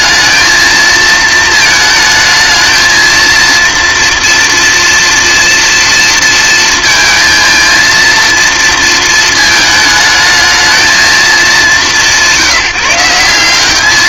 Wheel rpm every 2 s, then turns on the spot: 220, 220, 230, 230, 230, 220, 180.
none